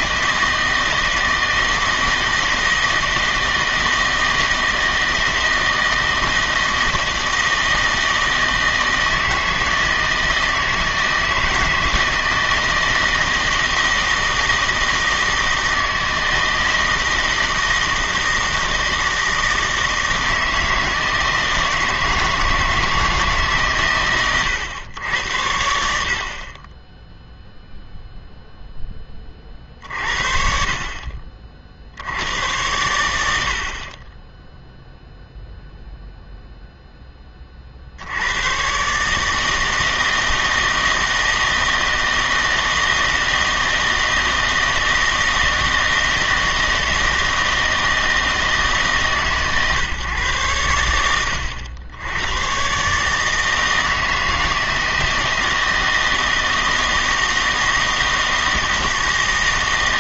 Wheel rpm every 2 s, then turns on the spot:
160, 160, 160, 160, 160, 160, 160, 160, 160, 160, 160, 160, 110, 20, 0, 50, 100, 0, 0, 120, 160, 160, 160, 160, 160, 100, 130, 160, 160, 160.
none